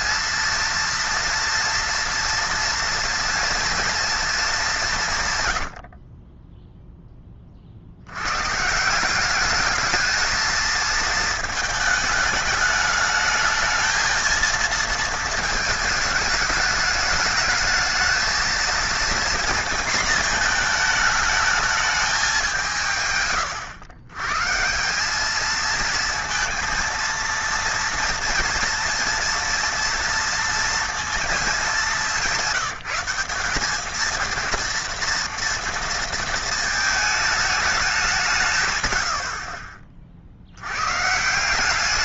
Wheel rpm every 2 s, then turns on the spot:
230, 230, 210, 20, 130, 220, 220, 230, 220, 230, 220, 190, 150, 230, 230, 230, 190, 230, 220, 130, 60.
6-8